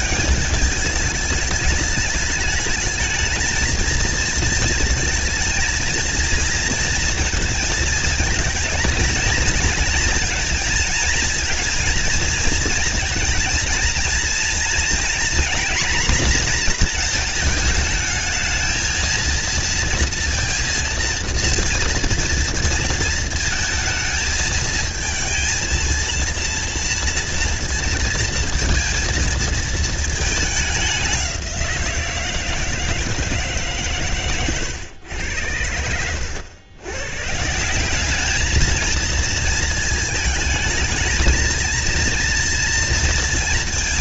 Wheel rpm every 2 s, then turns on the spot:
200, 210, 230, 230, 220, 220, 230, 230, 240, 220, 230, 230, 230, 230, 230, 200, 160, 120, 110, 220, 220, 230.
none